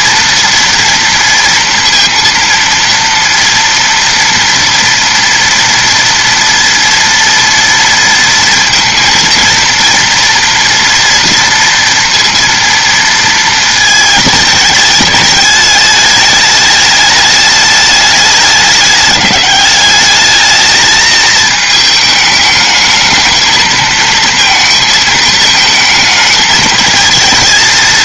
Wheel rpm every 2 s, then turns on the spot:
230, 230, 230, 230, 230, 240, 230, 210, 210, 200, 220, 220, 220, 220.
none